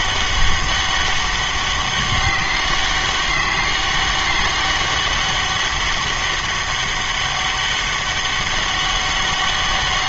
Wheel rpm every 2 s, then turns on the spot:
200, 190, 200, 200, 200.
none